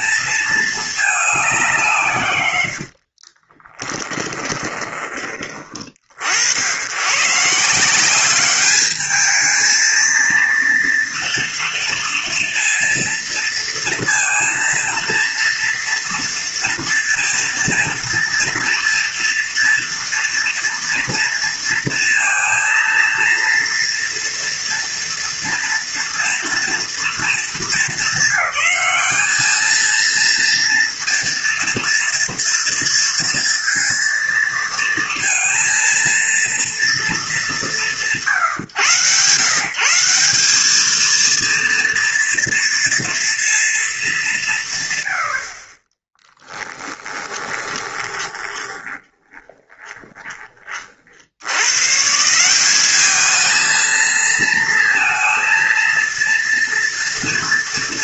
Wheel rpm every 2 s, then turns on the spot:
220, 100, 20, 100, 200, 230, 230, 230, 230, 230, 230, 230, 230, 230, 210, 230, 230, 230, 230, 150, 210, 230, 140, 10, 20, 40, 190, 230, 230.
2-6 46-50